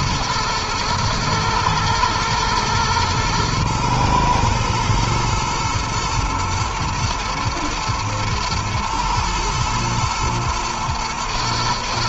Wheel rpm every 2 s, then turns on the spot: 110, 110, 110, 110, 110, 110.
none